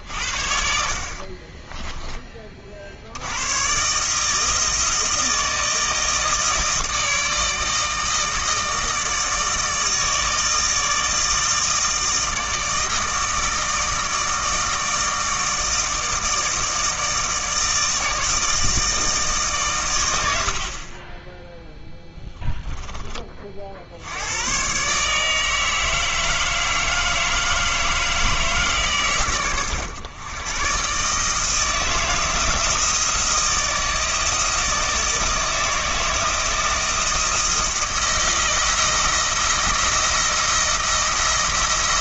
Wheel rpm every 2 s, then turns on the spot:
50, 40, 160, 160, 160, 160, 160, 160, 160, 160, 60, 10, 120, 160, 150, 120, 160, 160, 160, 160, 170.
none